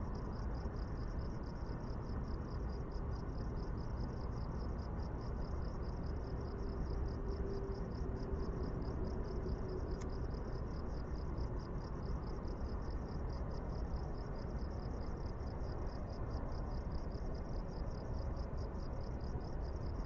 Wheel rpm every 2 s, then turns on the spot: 0, 0, 0, 0, 0, 0, 0, 0, 0, 0.
none